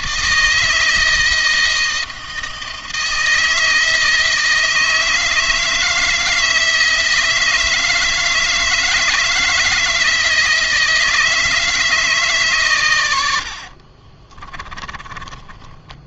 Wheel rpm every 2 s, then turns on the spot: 160, 160, 160, 160, 160, 160, 130, 30.
14-16